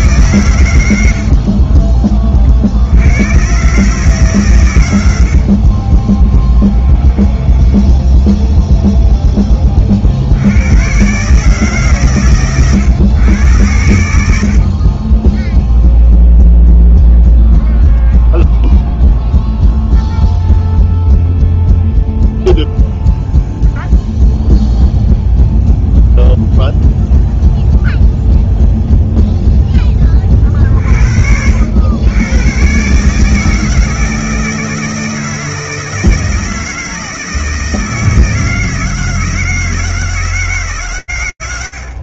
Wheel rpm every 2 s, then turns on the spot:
40, 120, 70, 10, 10, 140, 110, 10, 0, 0, 0, 0, 0, 0, 0, 50, 140, 160, 160, 160, 130.
0-2 4-8